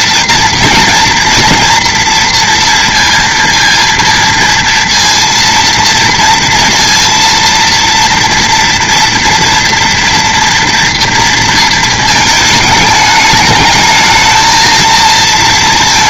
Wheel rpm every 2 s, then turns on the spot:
230, 230, 230, 230, 230, 230, 210, 220.
none